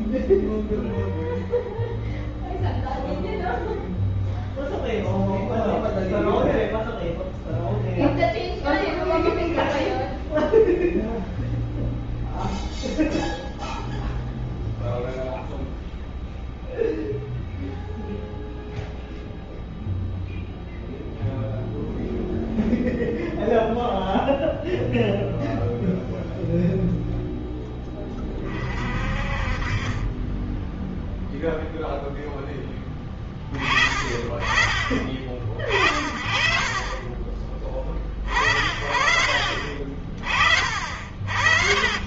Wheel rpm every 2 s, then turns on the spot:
0, 0, 0, 0, 0, 0, 0, 0, 0, 0, 0, 0, 0, 0, 30, 10, 10, 30, 40, 40, 40.
36-38